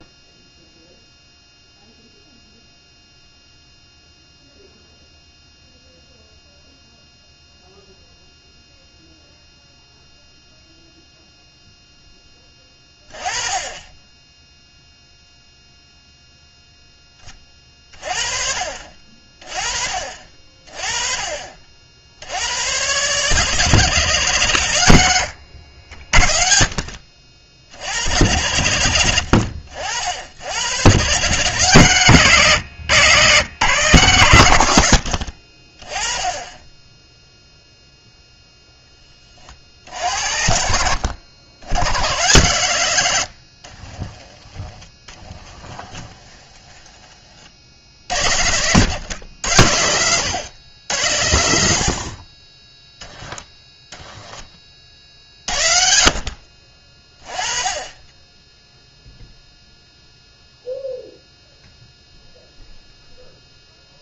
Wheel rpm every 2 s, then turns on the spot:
0, 0, 0, 0, 0, 0, 20, 0, 0, 40, 40, 100, 120, 50, 90, 100, 130, 110, 20, 0, 70, 110, 20, 10, 90, 90, 20, 30, 40, 0, 0, 0.
44-48